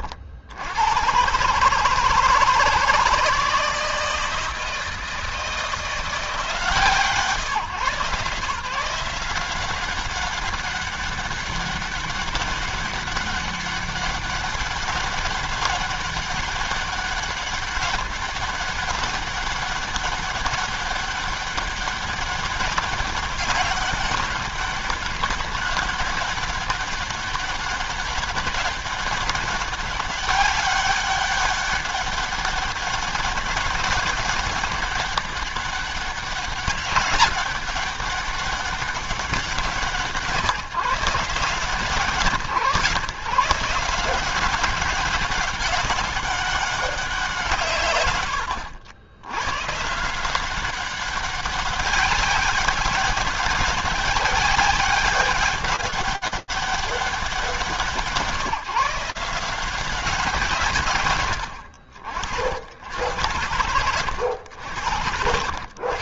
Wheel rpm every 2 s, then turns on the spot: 90, 160, 160, 150, 170, 200, 200, 200, 200, 200, 200, 200, 200, 190, 200, 200, 200, 190, 200, 200, 160, 150, 190, 190, 90, 190, 190, 200, 200, 160, 60, 90, 70.
none